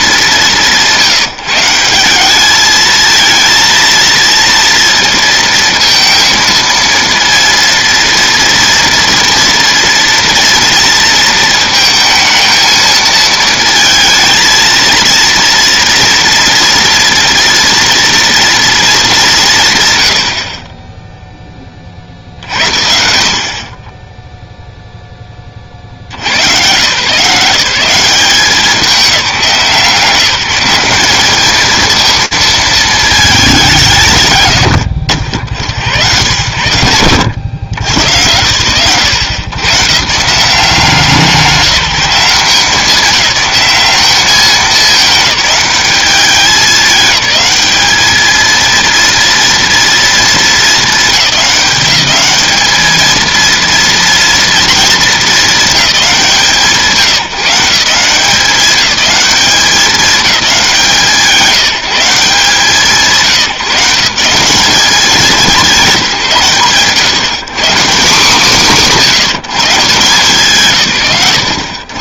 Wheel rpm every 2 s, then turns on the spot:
150, 220, 230, 230, 230, 230, 220, 230, 230, 230, 30, 60, 0, 130, 190, 190, 220, 130, 100, 100, 170, 180, 210, 210, 230, 210, 220, 220, 150, 200, 160, 140, 200, 130, 150, 100.
none